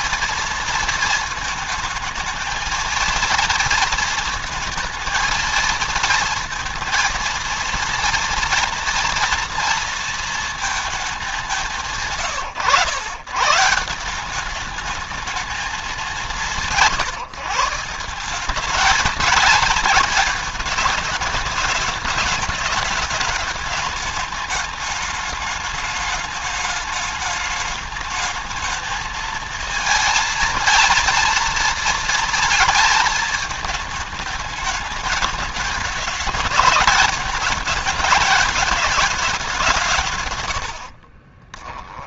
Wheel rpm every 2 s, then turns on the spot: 230, 220, 230, 230, 230, 230, 130, 200, 170, 190, 210, 210, 210, 210, 220, 230, 220, 210, 220, 210, 90.
40-42